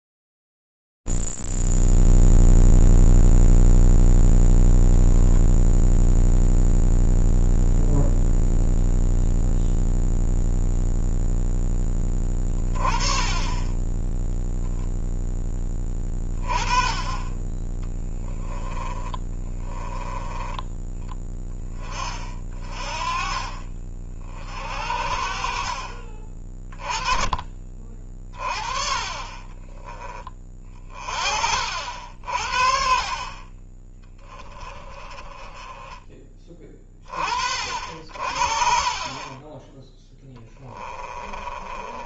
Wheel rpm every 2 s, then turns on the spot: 40, 0, 0, 0, 0, 0, 10, 10, 20, 20, 20, 30, 50, 30, 30, 30, 60, 20, 20, 40, 10.
18-20 40-42